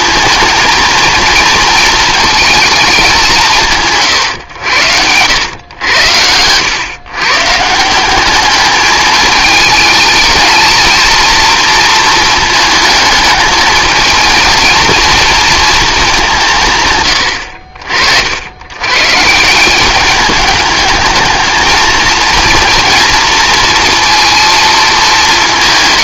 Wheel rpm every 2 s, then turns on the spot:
230, 220, 100, 110, 210, 220, 220, 230, 140, 100, 220, 230, 220.
none